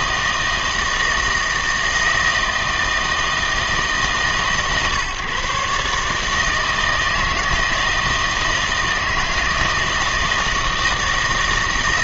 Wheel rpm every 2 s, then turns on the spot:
160, 160, 130, 160, 160, 160.
none